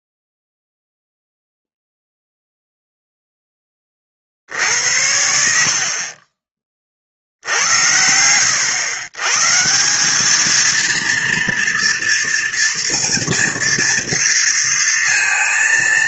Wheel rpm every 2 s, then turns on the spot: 0, 0, 0, 60, 70, 140, 230, 240.
none